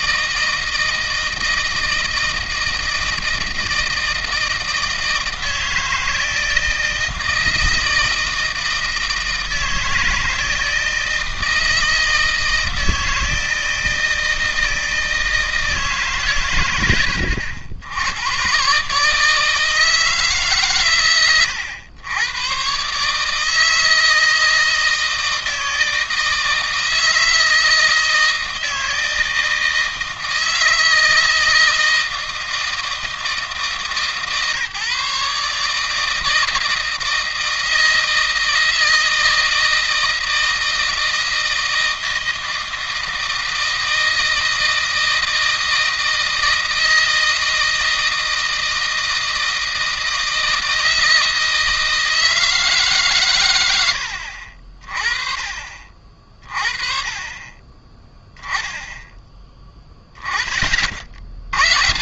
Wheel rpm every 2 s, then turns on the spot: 160, 160, 160, 160, 160, 160, 160, 160, 100, 140, 130, 140, 160, 160, 160, 160, 160, 150, 160, 160, 160, 160, 160, 160, 160, 160, 130, 40, 30, 10, 40.
none